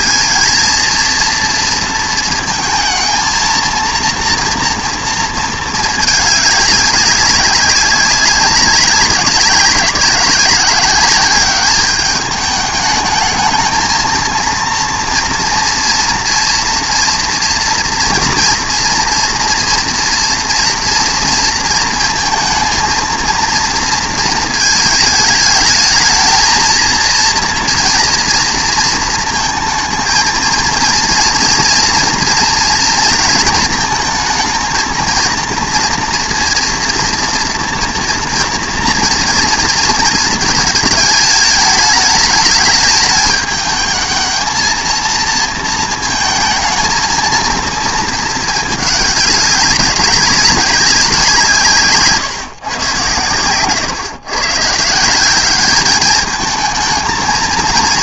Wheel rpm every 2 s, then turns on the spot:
230, 220, 230, 200, 190, 190, 210, 230, 230, 230, 240, 230, 220, 220, 230, 230, 230, 230, 230, 230, 220, 210, 230, 220, 210, 190, 130, 140, 220.
none